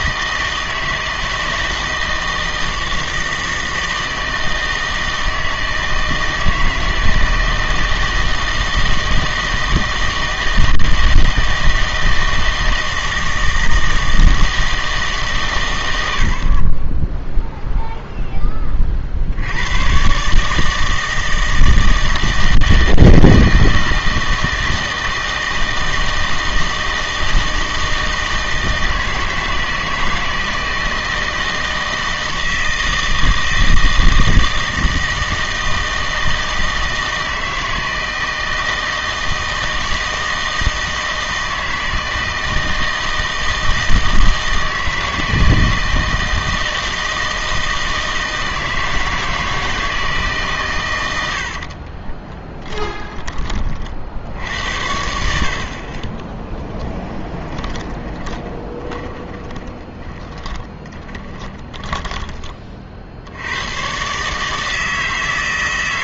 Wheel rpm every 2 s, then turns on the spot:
160, 160, 160, 160, 160, 160, 160, 160, 40, 20, 150, 160, 160, 160, 160, 160, 160, 160, 160, 160, 160, 160, 160, 160, 160, 140, 20, 80, 20, 20, 50, 30, 150.
52-54 56-62